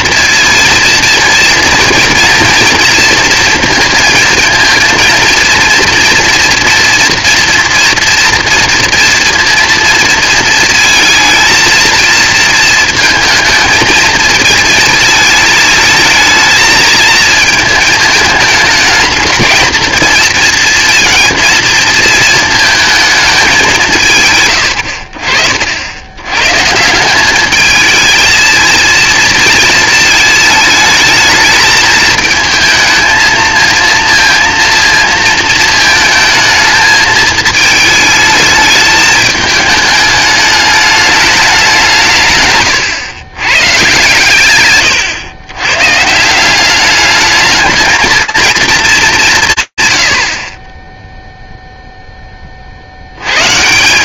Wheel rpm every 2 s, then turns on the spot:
230, 230, 220, 230, 230, 230, 230, 220, 230, 210, 230, 220, 100, 140, 230, 220, 220, 230, 220, 220, 210, 120, 120, 190, 230, 40, 50.
42-44